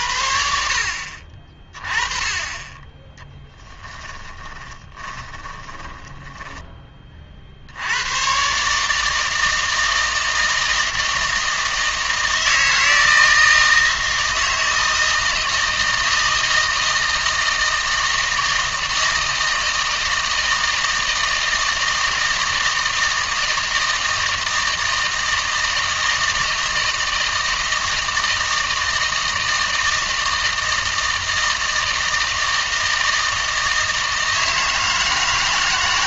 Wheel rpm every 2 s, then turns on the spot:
60, 20, 20, 10, 140, 160, 160, 160, 160, 160, 160, 160, 160, 160, 160, 160, 160, 160.
4-6